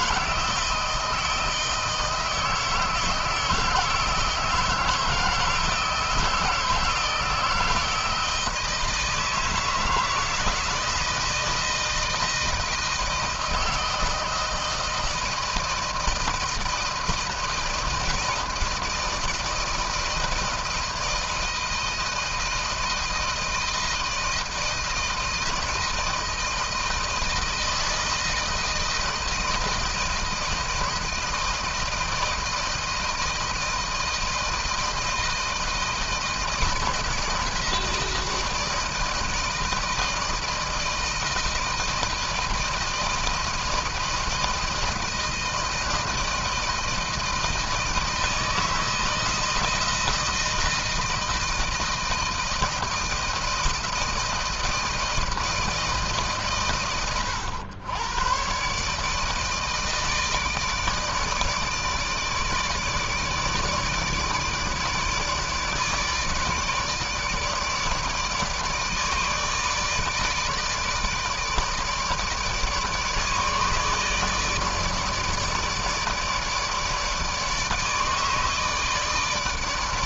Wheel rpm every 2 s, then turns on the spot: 160, 160, 160, 160, 160, 160, 160, 160, 160, 160, 160, 160, 160, 160, 160, 160, 160, 160, 170, 160, 160, 160, 160, 160, 160, 160, 160, 160, 130, 130, 160, 150, 150, 150, 160, 150, 150, 150, 160, 150.
none